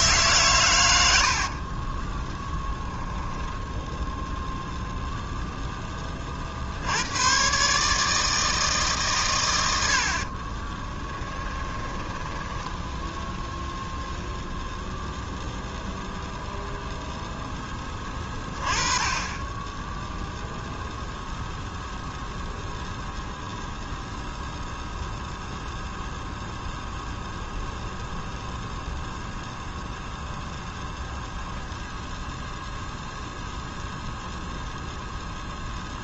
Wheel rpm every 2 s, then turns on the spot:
120, 10, 0, 60, 150, 20, 10, 0, 0, 30, 0, 0, 0, 0, 0, 0, 0, 0.
2-4 10-14